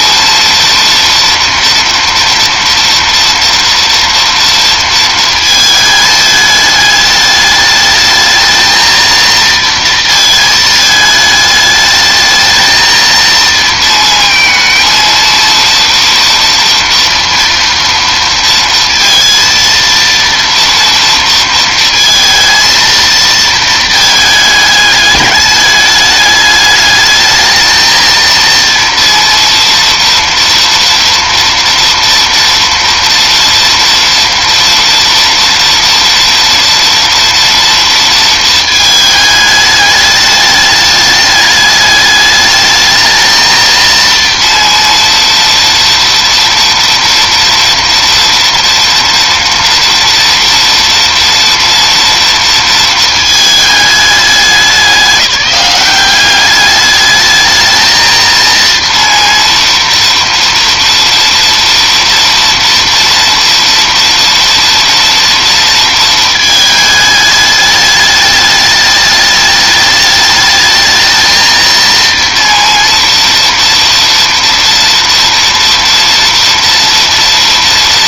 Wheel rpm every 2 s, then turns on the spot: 230, 230, 230, 220, 220, 230, 220, 230, 230, 230, 230, 220, 220, 210, 230, 230, 230, 230, 230, 230, 210, 210, 230, 230, 230, 230, 230, 210, 190, 220, 230, 230, 230, 230, 210, 210, 230, 230, 230.
none